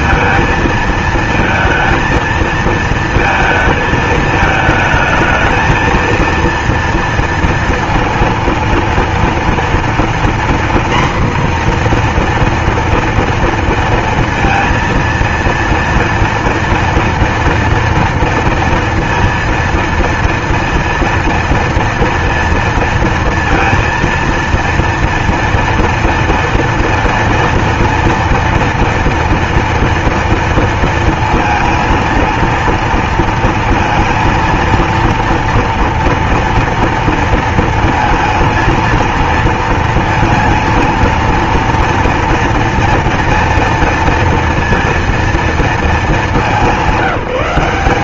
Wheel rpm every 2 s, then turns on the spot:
230, 230, 220, 230, 230, 240, 240, 230, 230, 230, 230, 230, 230, 230, 230, 230, 230, 230, 230, 220, 230, 230, 230, 200.
none